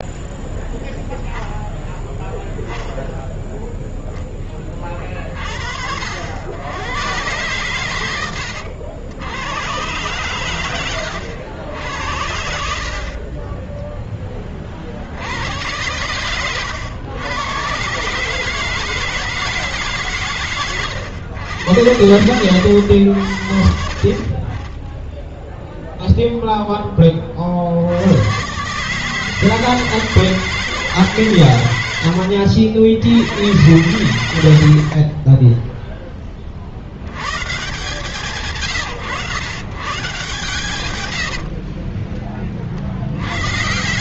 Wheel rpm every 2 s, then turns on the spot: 0, 0, 40, 110, 110, 90, 40, 80, 110, 160, 110, 80, 10, 30, 150, 140, 100, 10, 100, 130, 70, 100.
12-14 40-42